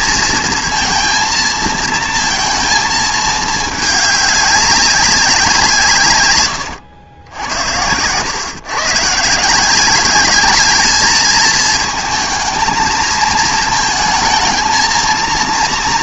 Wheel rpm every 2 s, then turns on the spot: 220, 230, 200, 100, 120, 210, 220, 220.
none